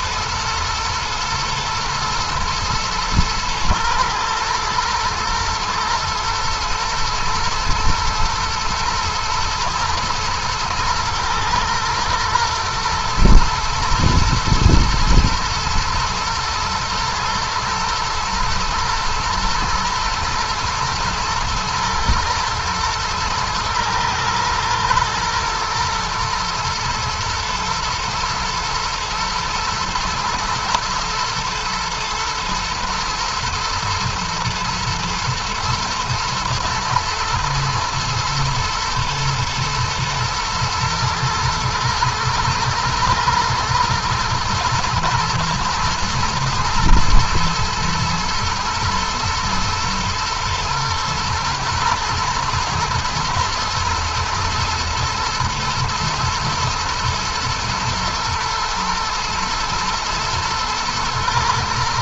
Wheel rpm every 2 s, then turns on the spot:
120, 110, 110, 110, 120, 110, 120, 110, 110, 110, 110, 110, 110, 110, 120, 120, 120, 110, 110, 110, 110, 120, 120, 120, 120, 120, 110, 110, 110, 120, 110.
none